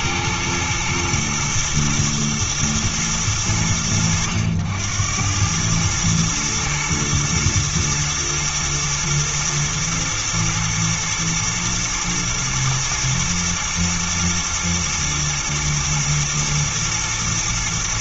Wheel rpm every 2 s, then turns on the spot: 110, 110, 90, 110, 110, 110, 120, 110, 110.
none